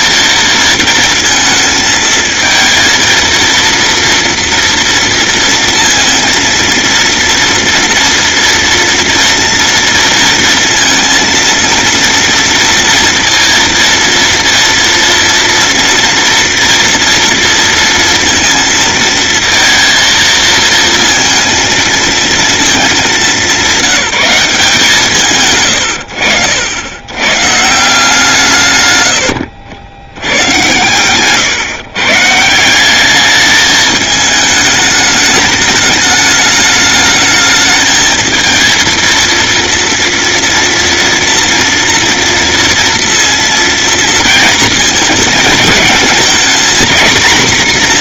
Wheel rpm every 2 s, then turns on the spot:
230, 230, 230, 230, 230, 230, 230, 230, 230, 230, 230, 170, 70, 150, 90, 140, 210, 210, 220, 230, 240, 230, 220, 240.
none